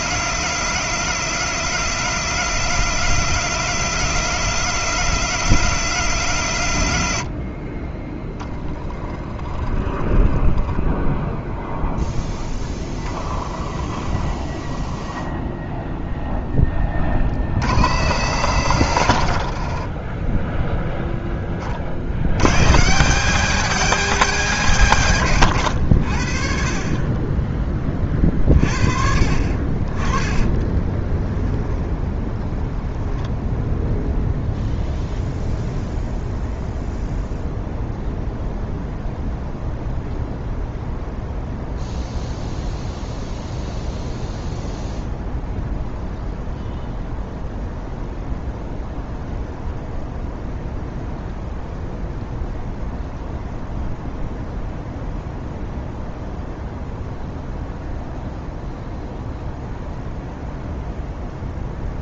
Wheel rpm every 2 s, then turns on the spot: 170, 170, 170, 120, 10, 0, 10, 0, 10, 100, 0, 140, 180, 40, 40, 20, 10, 0, 0, 0, 0, 0, 0, 0, 0, 0, 0, 0, 0, 0, 0.
8-10 30-32